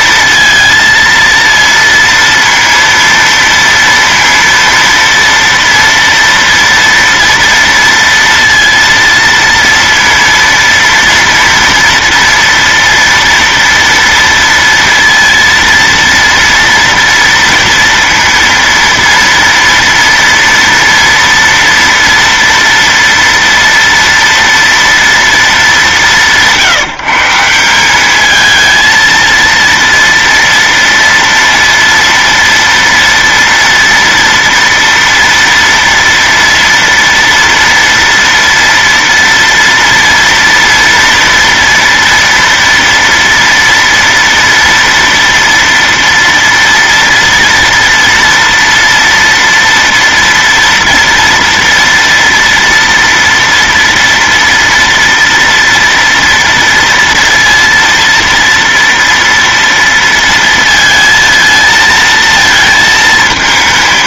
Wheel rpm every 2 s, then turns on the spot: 230, 230, 230, 230, 230, 230, 230, 230, 230, 230, 230, 230, 230, 150, 220, 230, 230, 240, 230, 230, 230, 230, 240, 230, 230, 230, 240, 230, 230, 230, 230, 230.
none